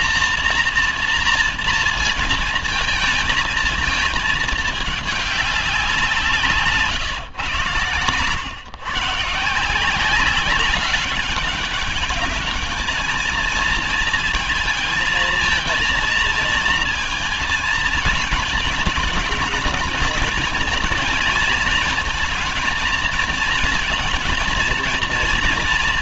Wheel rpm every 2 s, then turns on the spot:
230, 230, 220, 160, 130, 190, 210, 220, 230, 220, 230, 230, 230.
none